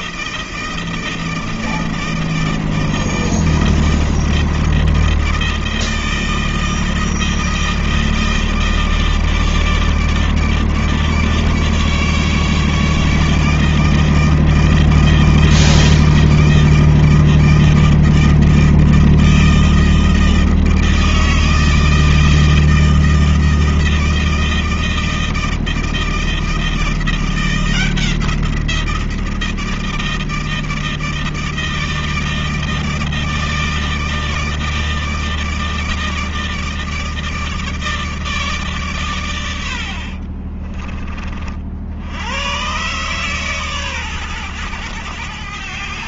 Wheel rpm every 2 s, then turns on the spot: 160, 160, 160, 160, 160, 150, 150, 160, 160, 160, 160, 160, 160, 170, 170, 160, 160, 160, 160, 140, 30, 120, 110.
none